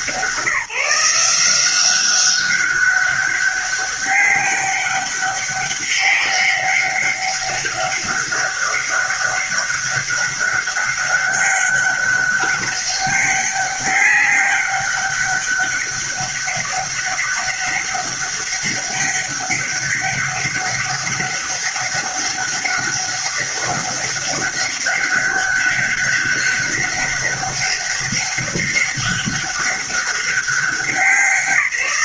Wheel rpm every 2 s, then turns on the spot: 180, 190, 200, 200, 200, 200, 200, 200, 200, 190, 200, 200, 200, 200, 200, 190.
none